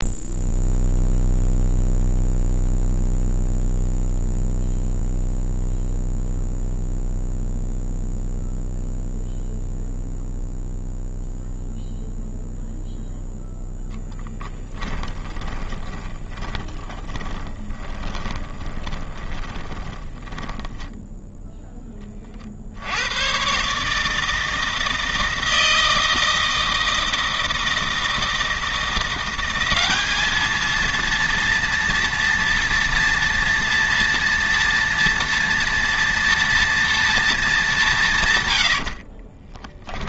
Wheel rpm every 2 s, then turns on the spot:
0, 0, 0, 0, 0, 0, 0, 10, 30, 20, 10, 70, 160, 160, 170, 220, 230, 230, 230, 80.
16-22